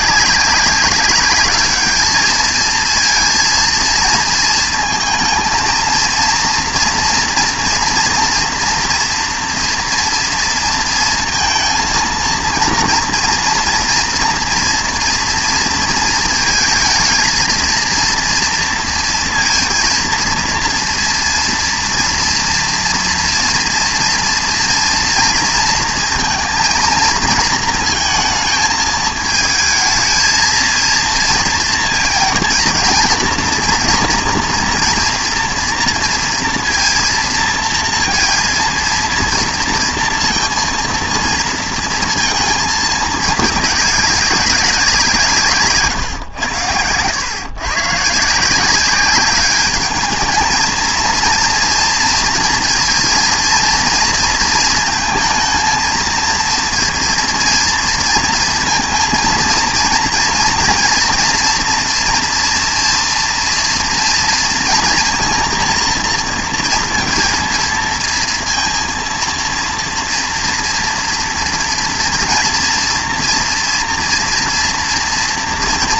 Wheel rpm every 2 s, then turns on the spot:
200, 230, 230, 230, 230, 230, 230, 230, 220, 230, 230, 230, 240, 230, 220, 230, 230, 230, 230, 230, 230, 220, 190, 100, 180, 220, 230, 230, 230, 230, 230, 230, 230, 230, 230, 230, 230, 230.
none